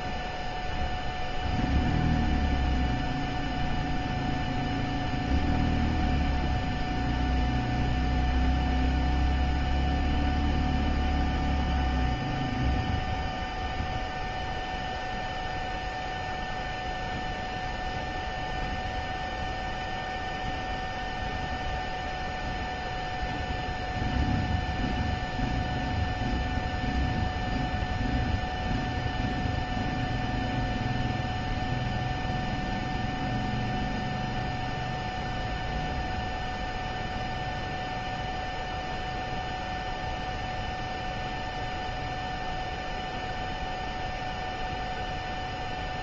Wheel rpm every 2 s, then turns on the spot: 0, 0, 0, 0, 0, 0, 0, 0, 0, 0, 0, 0, 0, 0, 0, 0, 0, 0, 0, 0, 0, 0, 0.
none